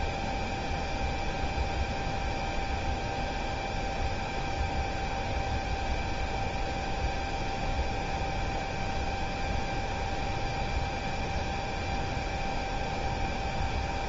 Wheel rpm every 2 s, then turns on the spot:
0, 0, 0, 0, 0, 0, 0.
none